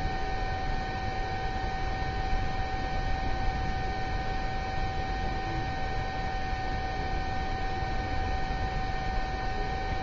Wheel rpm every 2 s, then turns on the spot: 0, 0, 0, 0, 0.
none